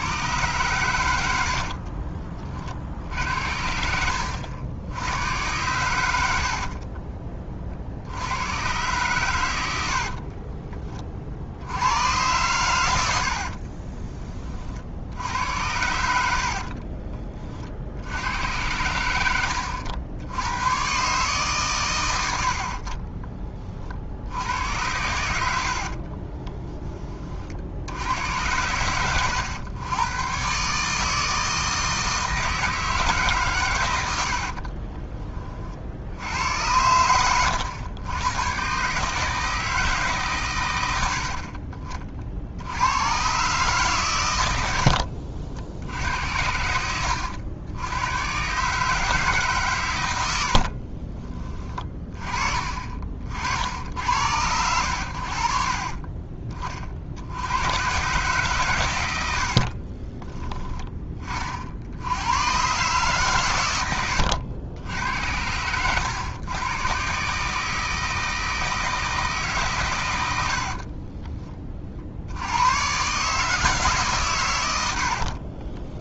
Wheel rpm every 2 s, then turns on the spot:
120, 50, 80, 40, 120, 30, 90, 60, 40, 100, 120, 40, 100, 30, 100, 150, 160, 30, 100, 130, 100, 90, 70, 90, 160, 40, 40, 80, 40, 120, 20, 130, 90, 120, 160, 40, 120, 80.
6-8 16-18 22-24 34-36 44-48 50-52 70-72 74-76